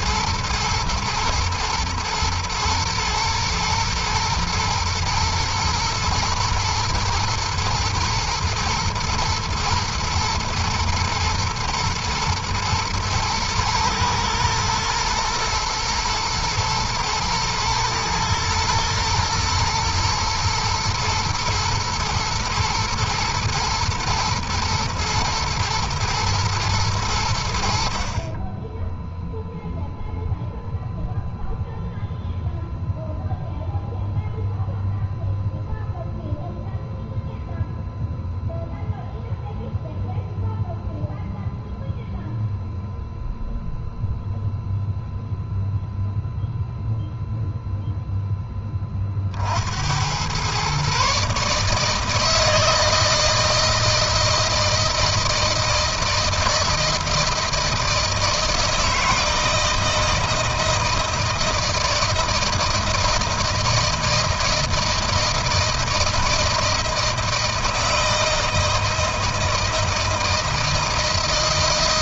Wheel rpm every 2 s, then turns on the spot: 120, 110, 110, 110, 110, 120, 120, 120, 110, 110, 120, 110, 120, 100, 10, 0, 0, 0, 0, 0, 0, 0, 0, 0, 30, 140, 160, 160, 160, 160, 160, 160, 160, 160, 160, 160.
none